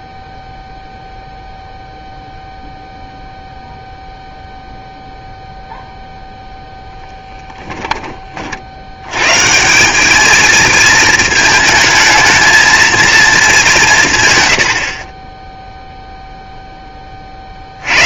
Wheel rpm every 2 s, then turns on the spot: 0, 0, 0, 0, 50, 220, 220, 100, 0.
none